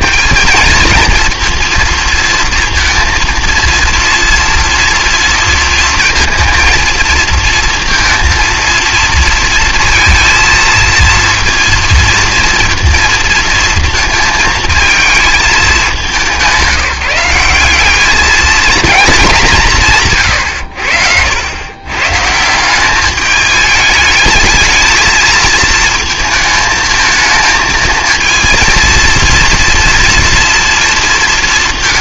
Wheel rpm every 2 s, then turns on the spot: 220, 230, 230, 230, 230, 230, 230, 220, 190, 220, 80, 190, 220, 220, 230, 230.
none